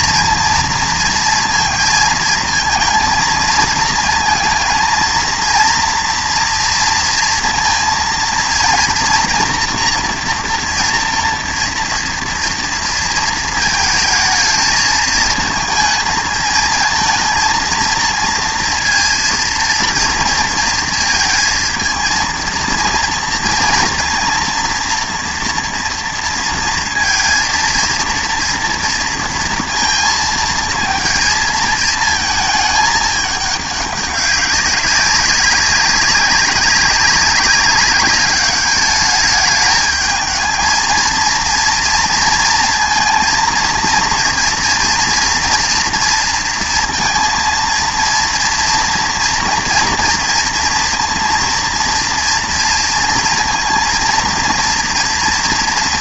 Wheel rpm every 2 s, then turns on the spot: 230, 230, 230, 230, 230, 230, 230, 220, 220, 230, 230, 230, 230, 230, 230, 230, 220, 200, 190, 200, 220, 220, 230, 230, 230, 230, 230, 230.
none